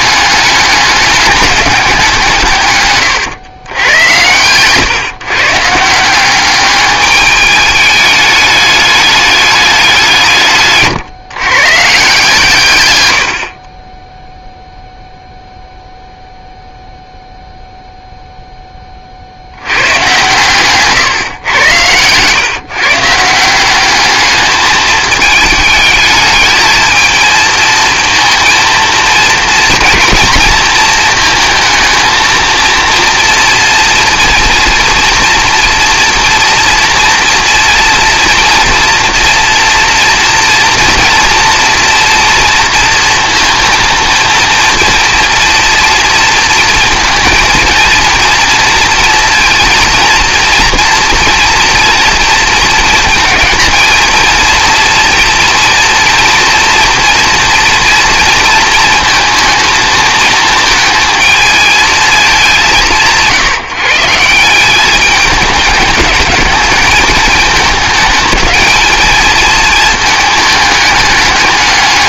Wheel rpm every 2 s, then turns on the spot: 210, 130, 130, 200, 210, 140, 110, 0, 0, 10, 130, 150, 210, 220, 220, 220, 230, 230, 240, 240, 230, 230, 230, 230, 230, 230, 220, 230, 230, 230, 230, 180, 200, 210, 220, 210.
10-12 20-22